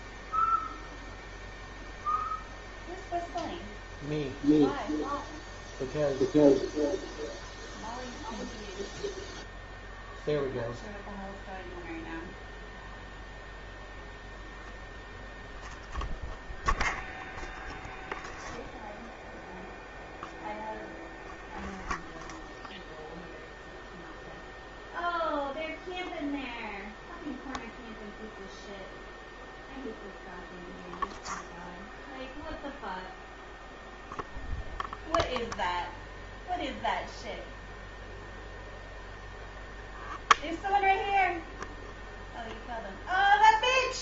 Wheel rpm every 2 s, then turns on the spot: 0, 0, 0, 0, 0, 0, 0, 0, 0, 0, 0, 0, 0, 0, 0, 0, 0, 0, 0, 0, 0, 0.
none